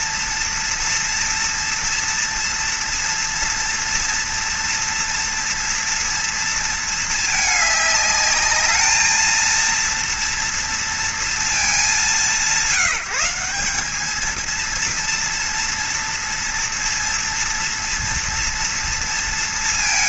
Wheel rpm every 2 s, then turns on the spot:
230, 230, 230, 230, 210, 230, 190, 230, 230, 230.
none